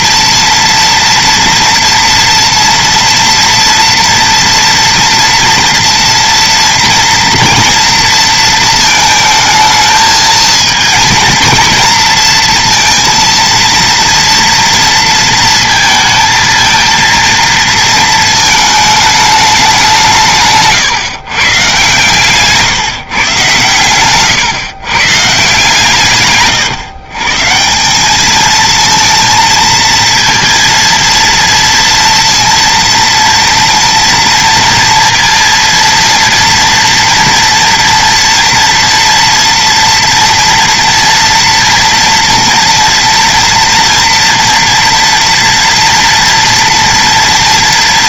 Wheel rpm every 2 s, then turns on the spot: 240, 230, 230, 230, 220, 230, 230, 230, 230, 220, 140, 150, 130, 130, 220, 230, 230, 230, 230, 230, 230, 230, 230, 230.
none